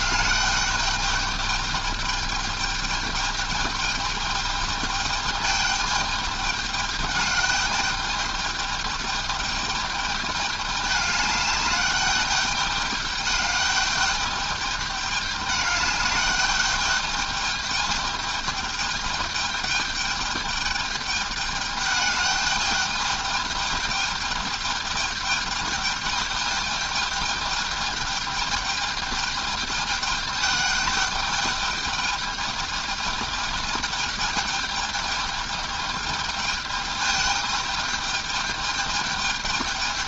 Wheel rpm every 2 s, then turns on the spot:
210, 210, 210, 210, 210, 210, 210, 210, 210, 210, 210, 210, 210, 210, 210, 210, 210, 210, 210, 210.
none